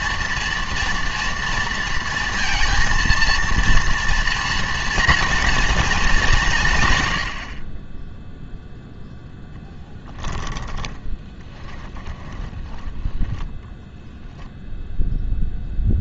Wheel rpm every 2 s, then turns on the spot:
230, 230, 230, 160, 0, 10, 20, 10.
10-12